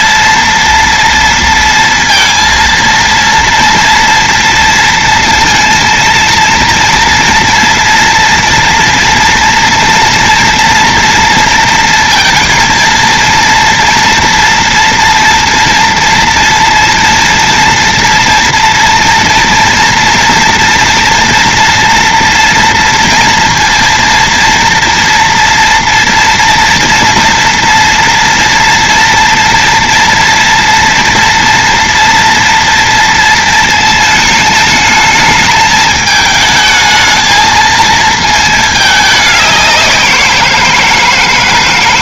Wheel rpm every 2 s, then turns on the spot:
230, 230, 230, 230, 230, 230, 230, 230, 230, 230, 230, 230, 230, 230, 230, 230, 230, 220, 220, 220, 180.
none